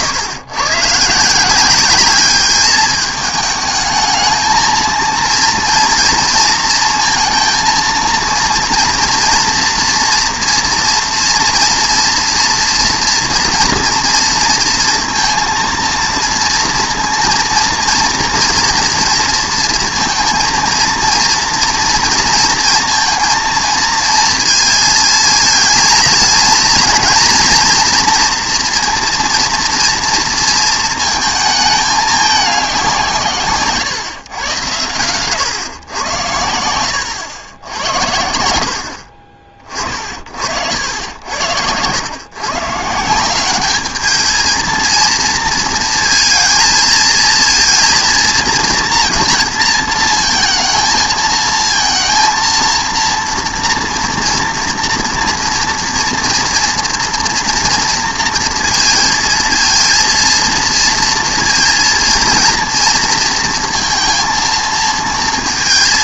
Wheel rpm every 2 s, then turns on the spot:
130, 210, 220, 230, 230, 230, 240, 230, 240, 230, 230, 230, 230, 230, 240, 230, 180, 110, 90, 60, 70, 150, 230, 220, 230, 230, 230, 230, 230, 230, 230, 230, 230.
none